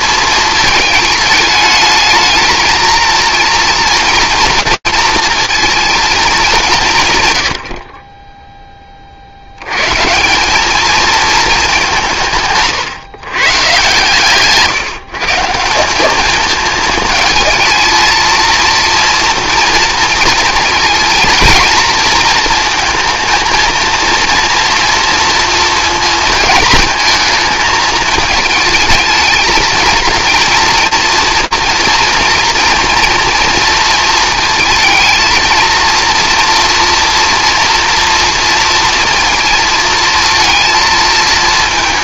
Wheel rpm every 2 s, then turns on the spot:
220, 220, 230, 180, 10, 200, 140, 150, 220, 230, 220, 230, 230, 220, 220, 230, 230, 220, 230, 230, 230.
none